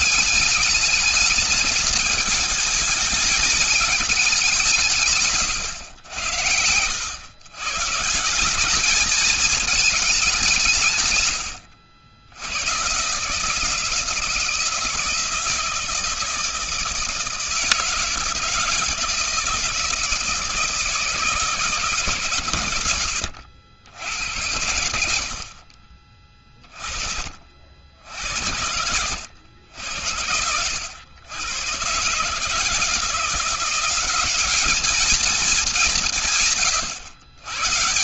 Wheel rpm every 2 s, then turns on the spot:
210, 220, 170, 90, 180, 170, 120, 170, 160, 160, 160, 130, 90, 30, 80, 90, 150, 200, 140.
none